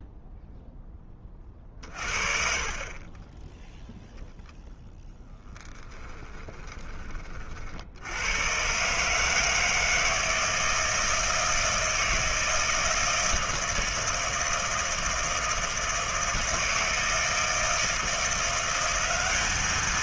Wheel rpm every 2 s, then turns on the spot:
10, 30, 0, 30, 140, 160, 160, 160, 160, 190.
none